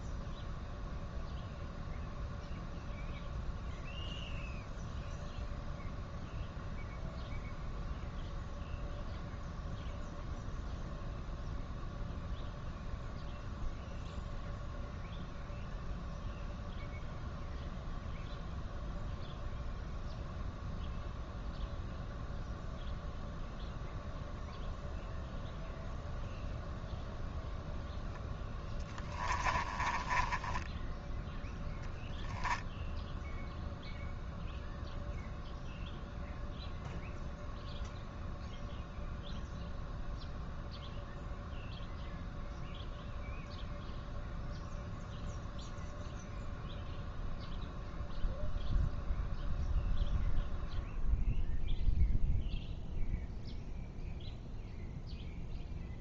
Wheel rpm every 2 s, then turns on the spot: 0, 0, 0, 0, 0, 0, 0, 0, 0, 0, 0, 0, 0, 0, 10, 10, 10, 0, 0, 0, 0, 0, 0, 0, 0, 0, 0, 0.
28-32